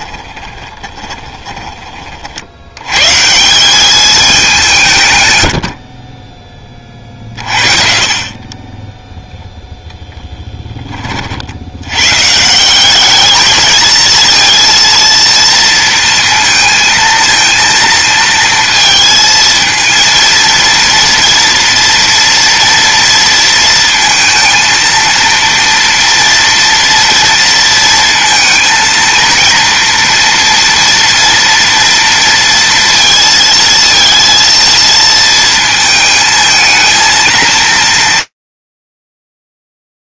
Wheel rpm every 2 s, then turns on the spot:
30, 90, 160, 30, 20, 20, 190, 230, 230, 230, 230, 230, 230, 230, 230, 230, 230, 230, 220, 100.
0-2